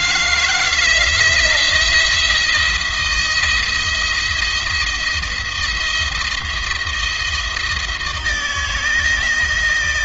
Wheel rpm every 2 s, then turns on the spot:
170, 170, 170, 170, 160.
none